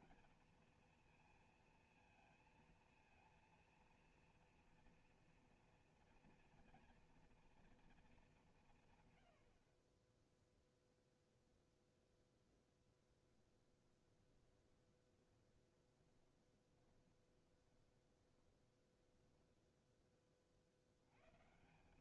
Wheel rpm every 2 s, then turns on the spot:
230, 230, 240, 230, 150, 0, 0, 20, 20, 10, 70.
14-20